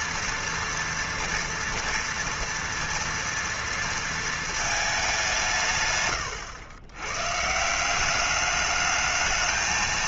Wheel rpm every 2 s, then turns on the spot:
230, 230, 220, 90, 200.
none